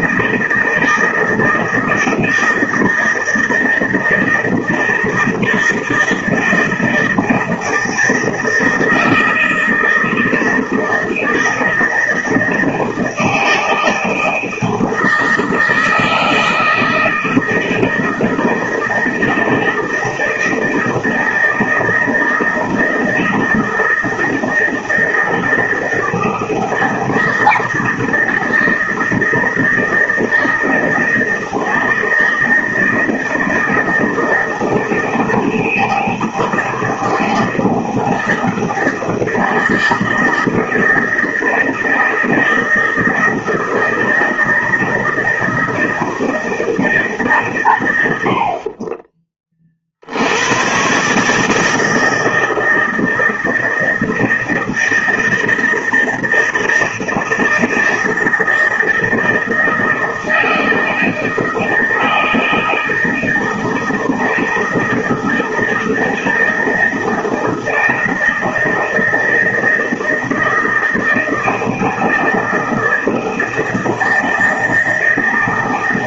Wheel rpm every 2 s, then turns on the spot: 160, 160, 160, 160, 160, 160, 160, 160, 160, 160, 160, 160, 160, 160, 160, 160, 160, 160, 160, 160, 160, 160, 160, 160, 40, 120, 160, 160, 160, 160, 160, 160, 160, 160, 160, 160, 160, 160.
none